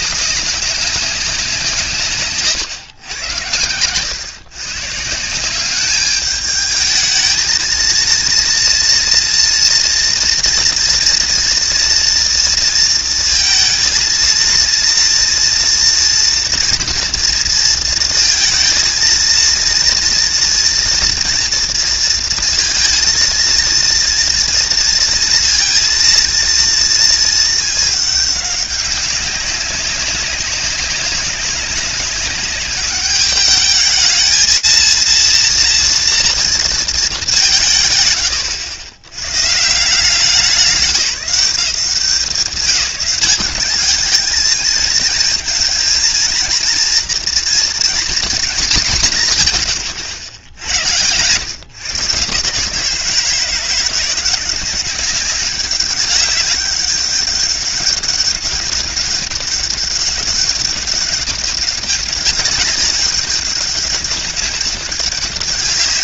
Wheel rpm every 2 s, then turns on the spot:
190, 120, 130, 210, 230, 230, 230, 230, 230, 230, 230, 230, 230, 230, 200, 200, 210, 220, 220, 100, 170, 180, 220, 230, 200, 90, 150, 190, 200, 190, 200, 200, 200.
none